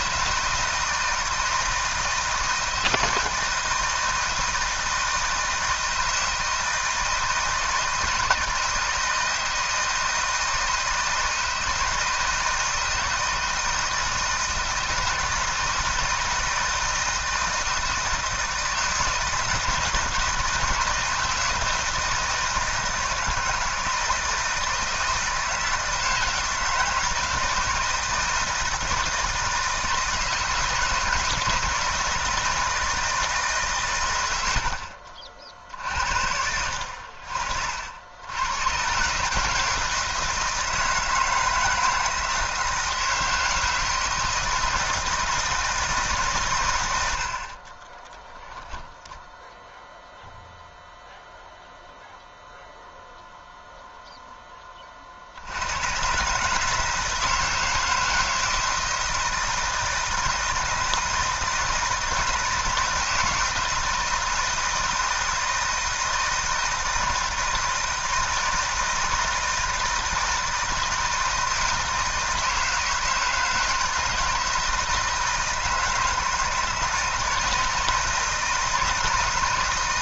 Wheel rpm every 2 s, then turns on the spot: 160, 170, 160, 160, 160, 160, 160, 160, 160, 160, 160, 160, 170, 160, 160, 160, 160, 80, 70, 110, 160, 160, 160, 120, 0, 0, 0, 20, 150, 160, 160, 160, 160, 170, 160, 160, 160, 160, 160, 160.
none